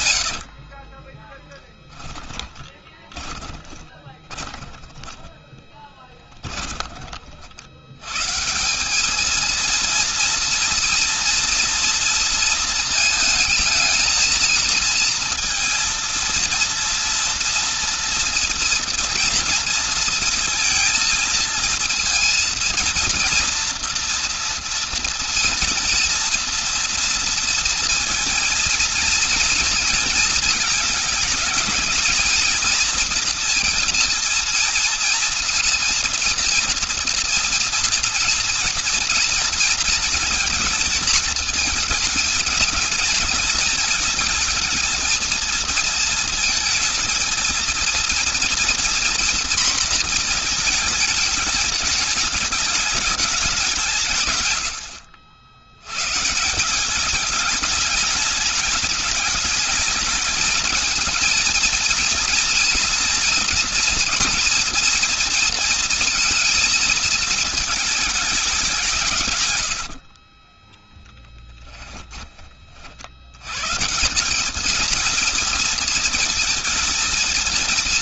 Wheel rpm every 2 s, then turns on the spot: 60, 20, 10, 20, 160, 230, 230, 220, 230, 230, 230, 230, 230, 230, 230, 220, 230, 230, 230, 230, 220, 220, 220, 220, 230, 230, 200, 120, 170, 220, 220, 230, 230, 230, 200, 20, 40, 210, 230.
0-6 70-72